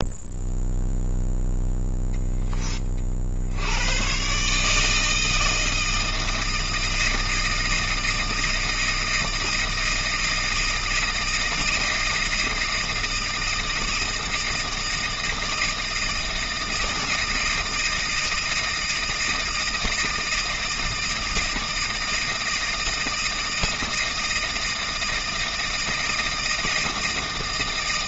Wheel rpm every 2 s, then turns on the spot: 0, 10, 150, 160, 160, 160, 160, 160, 160, 160, 160, 160, 160, 160.
none